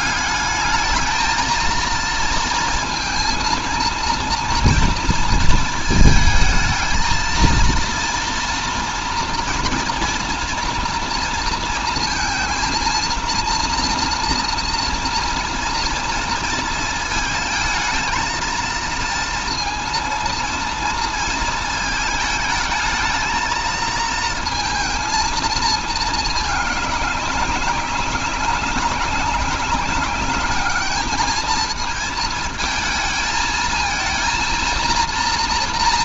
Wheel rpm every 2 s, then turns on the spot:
200, 230, 230, 220, 240, 240, 230, 230, 230, 230, 230, 220, 220, 210, 190, 210, 220, 230.
none